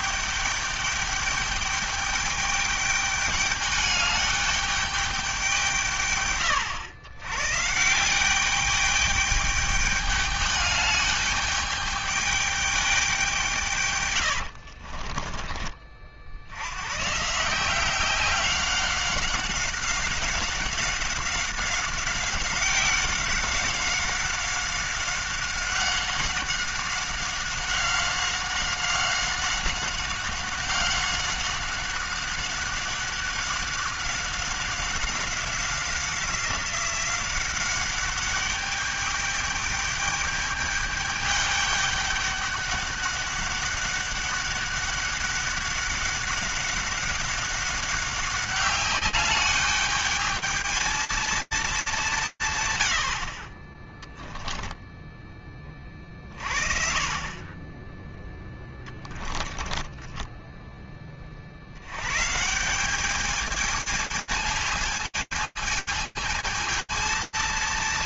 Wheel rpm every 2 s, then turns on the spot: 210, 210, 210, 130, 180, 210, 210, 110, 70, 190, 190, 190, 190, 190, 190, 190, 190, 190, 190, 200, 210, 200, 200, 200, 200, 220, 120, 10, 50, 10, 30, 200, 220, 230.
14-16 54-56 58-60